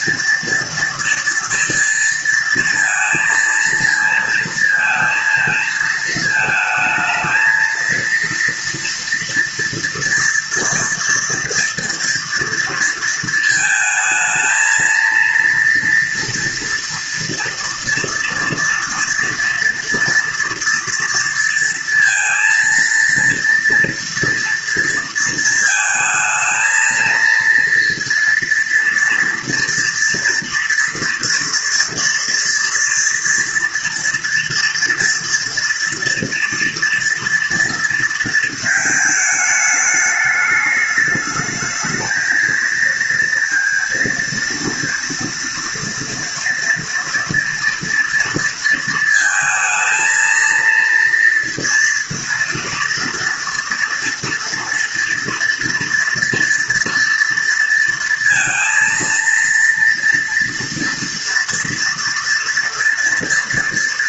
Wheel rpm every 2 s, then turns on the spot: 230, 230, 220, 220, 230, 230, 230, 230, 230, 230, 240, 230, 230, 220, 230, 230, 230, 230, 230, 230, 210, 230, 230, 230, 230, 230, 230, 230, 230, 230, 230, 230.
none